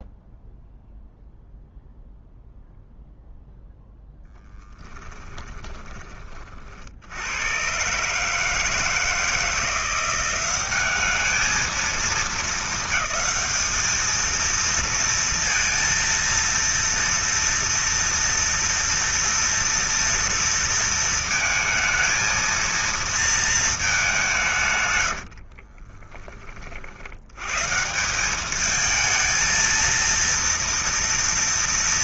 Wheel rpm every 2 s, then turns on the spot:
0, 0, 10, 60, 160, 200, 220, 230, 230, 230, 230, 230, 120, 60, 220, 230.
4-6